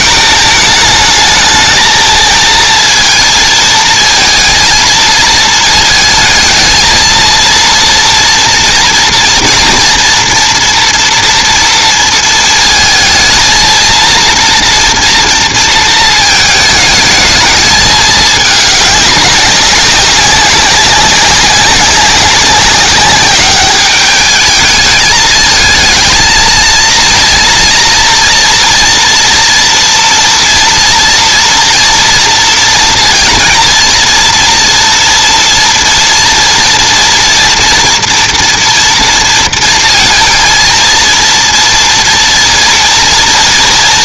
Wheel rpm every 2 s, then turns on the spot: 220, 230, 230, 220, 230, 240, 230, 230, 220, 210, 200, 190, 220, 230, 230, 240, 230, 240, 240, 230, 230, 230.
none